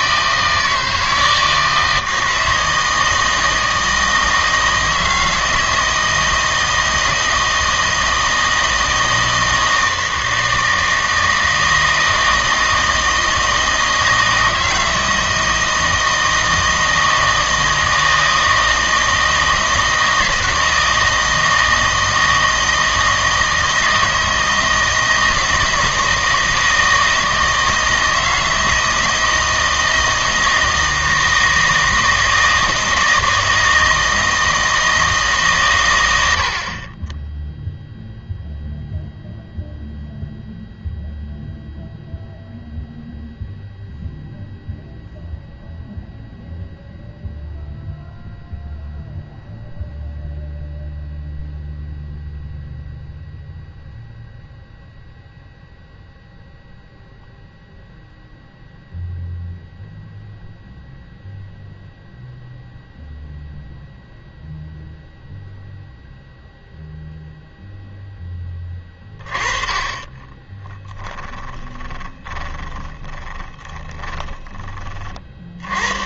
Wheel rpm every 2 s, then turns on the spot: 160, 160, 160, 160, 160, 160, 160, 160, 160, 160, 160, 160, 160, 160, 160, 160, 160, 160, 40, 0, 0, 0, 0, 0, 0, 0, 0, 0, 0, 0, 0, 0, 0, 0, 20, 20, 20, 20.
70-74